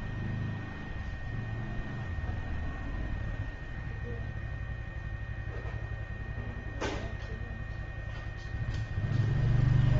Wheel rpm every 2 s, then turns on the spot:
0, 0, 0, 0, 0.
none